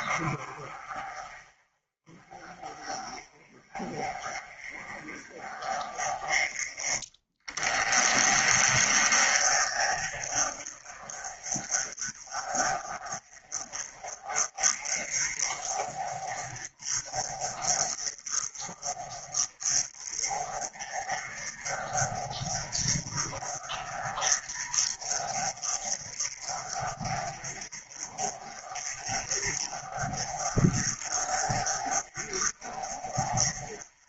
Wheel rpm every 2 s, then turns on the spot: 40, 30, 40, 20, 30, 30, 30, 40, 30, 30, 40, 40, 30, 40, 30, 40, 40.
none